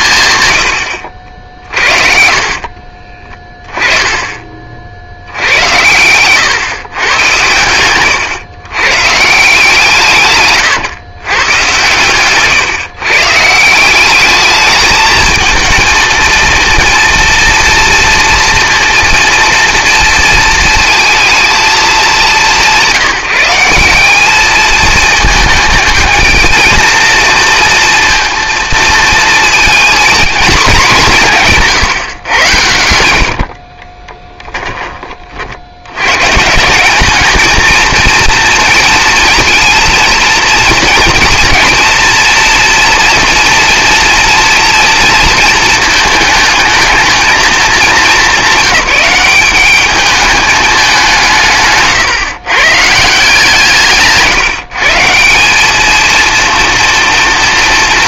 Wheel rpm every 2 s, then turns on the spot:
90, 40, 40, 130, 120, 130, 140, 210, 230, 230, 230, 180, 210, 230, 230, 220, 90, 20, 170, 230, 230, 230, 230, 220, 200, 210, 150, 160, 230.
2-4 32-36